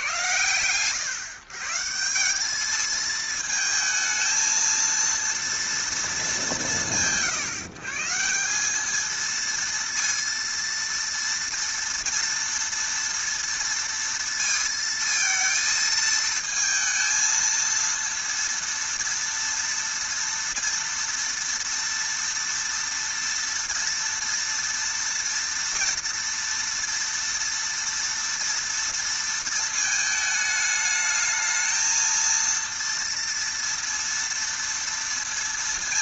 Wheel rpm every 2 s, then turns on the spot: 110, 210, 230, 160, 190, 230, 230, 230, 220, 230, 230, 230, 230, 230, 230, 210, 230, 230.
none